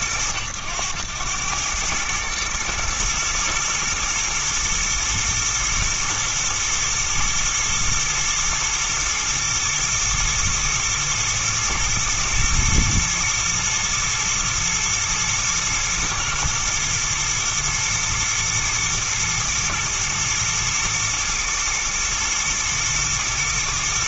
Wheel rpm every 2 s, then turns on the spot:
90, 110, 110, 120, 110, 110, 120, 120, 110, 120, 120, 120.
none